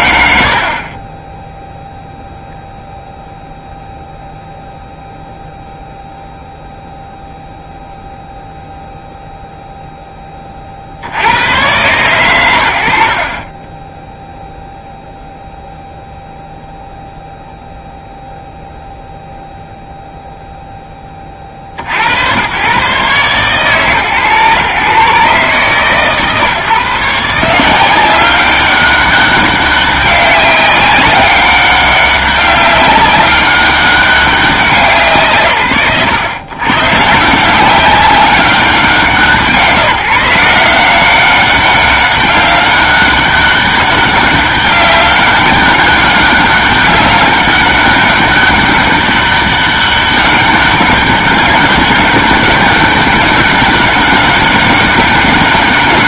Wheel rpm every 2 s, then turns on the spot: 40, 0, 0, 0, 0, 20, 80, 0, 0, 0, 20, 120, 130, 140, 200, 190, 190, 160, 130, 180, 180, 200, 200, 200, 200, 200, 200, 200.
none